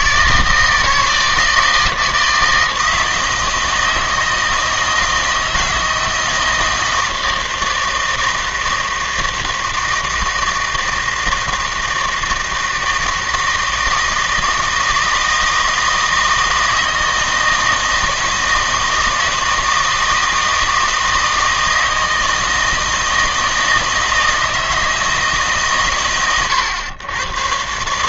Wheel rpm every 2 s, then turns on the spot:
160, 160, 160, 160, 160, 160, 160, 160, 160, 160, 160, 160, 160, 110.
none